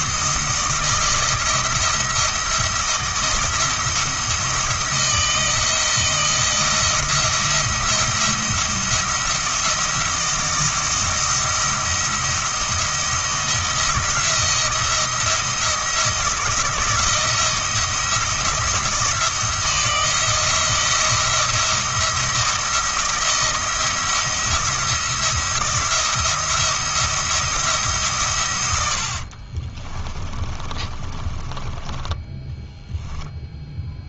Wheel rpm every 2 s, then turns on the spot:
160, 170, 160, 170, 170, 170, 170, 170, 170, 170, 170, 170, 170, 170, 100, 40, 10.
30-34